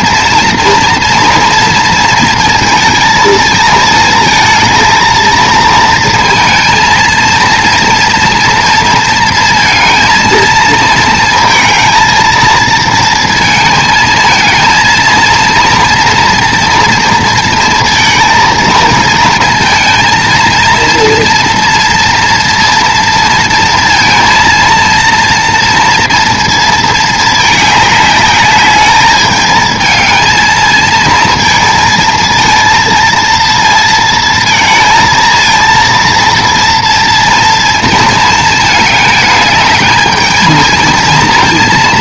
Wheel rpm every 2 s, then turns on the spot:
230, 230, 230, 230, 230, 220, 230, 230, 230, 220, 230, 230, 230, 220, 210, 230, 230, 230, 230, 220, 220.
none